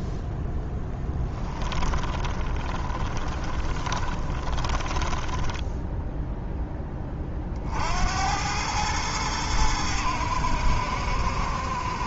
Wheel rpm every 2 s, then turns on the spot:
10, 20, 20, 10, 100, 70.
0-6